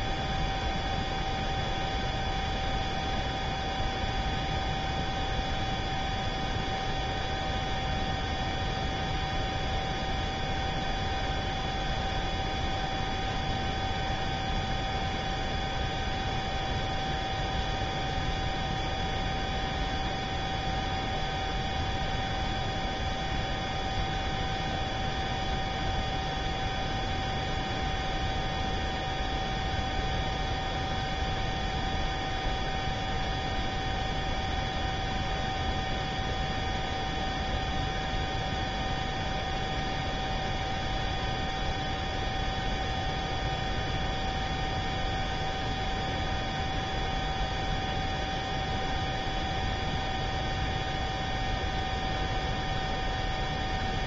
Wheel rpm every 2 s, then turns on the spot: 0, 0, 0, 0, 0, 0, 0, 0, 0, 0, 0, 0, 0, 0, 0, 0, 0, 0, 0, 0, 0, 0, 0, 0, 0, 0, 0.
none